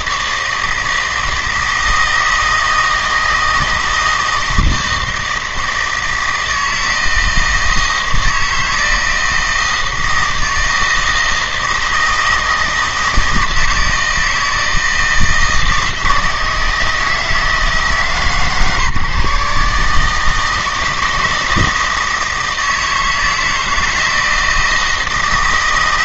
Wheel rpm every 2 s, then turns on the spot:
160, 160, 160, 160, 160, 160, 160, 160, 160, 140, 160, 160, 160.
none